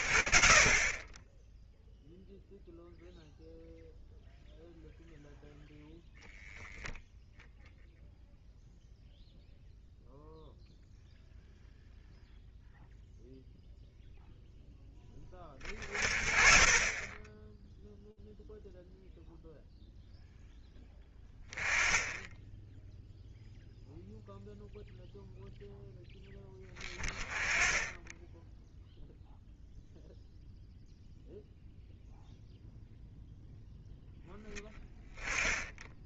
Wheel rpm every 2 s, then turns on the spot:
20, 0, 0, 0, 0, 0, 0, 10, 30, 0, 10, 0, 0, 20, 0, 0, 0, 10.
none